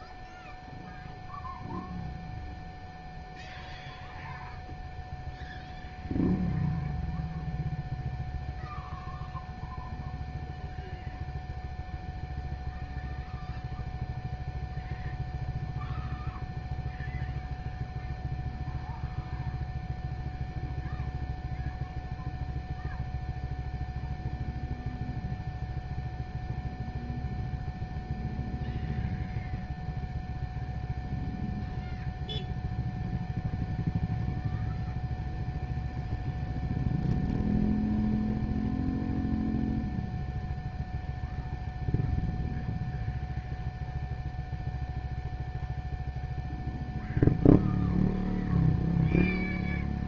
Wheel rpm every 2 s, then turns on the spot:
0, 0, 0, 0, 0, 0, 0, 0, 0, 0, 0, 0, 0, 0, 0, 0, 0, 0, 0, 0, 0, 0, 0, 0, 0.
none